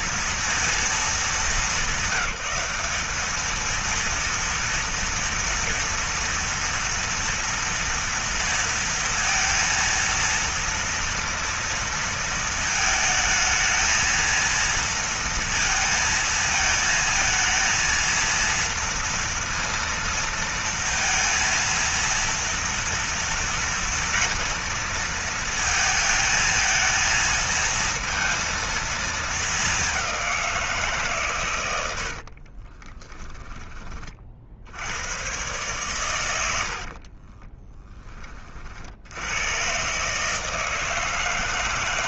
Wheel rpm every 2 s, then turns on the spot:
230, 200, 230, 230, 230, 230, 220, 230, 220, 230, 230, 230, 230, 220, 230, 150, 30, 90, 50, 70, 160.
32-34 36-38